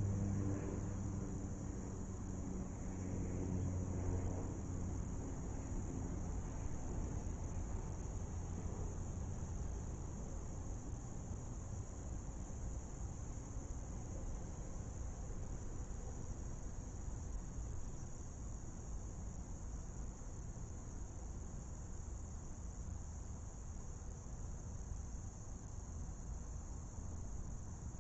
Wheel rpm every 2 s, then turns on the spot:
0, 0, 0, 0, 0, 0, 0, 0, 0, 0, 0, 0, 0, 0.
none